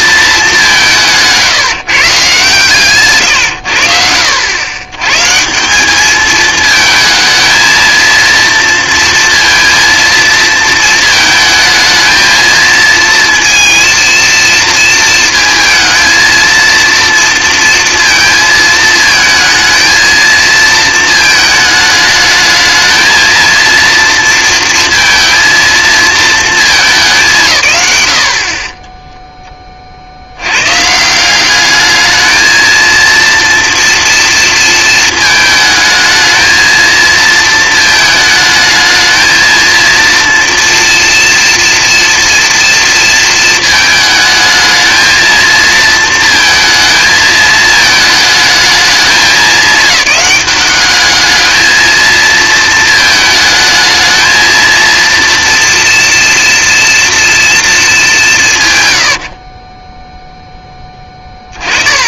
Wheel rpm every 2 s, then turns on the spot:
200, 140, 100, 220, 230, 220, 220, 230, 230, 230, 230, 220, 230, 210, 30, 100, 220, 230, 220, 220, 230, 230, 220, 220, 220, 200, 230, 230, 230, 130, 10.
none